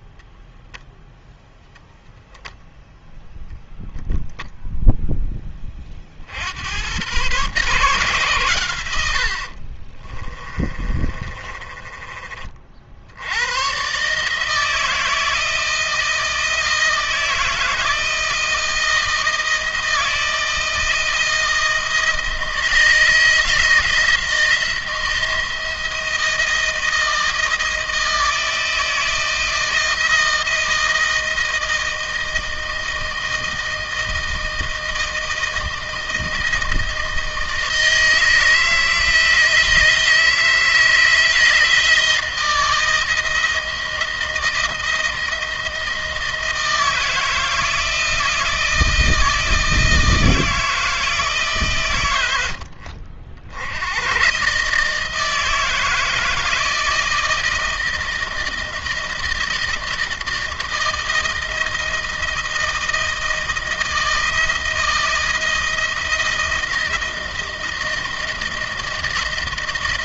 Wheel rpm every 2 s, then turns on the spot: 0, 0, 0, 100, 100, 30, 60, 160, 170, 160, 170, 160, 160, 160, 160, 160, 160, 160, 160, 160, 160, 160, 160, 160, 160, 160, 80, 160, 160, 160, 160, 160, 160, 170, 160.
10-12